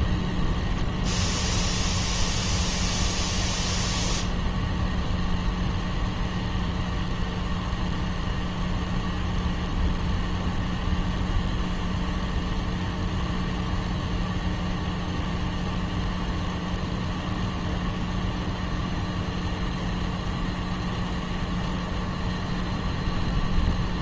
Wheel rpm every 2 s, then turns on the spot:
0, 0, 0, 0, 0, 0, 0, 0, 0, 0, 0, 0.
none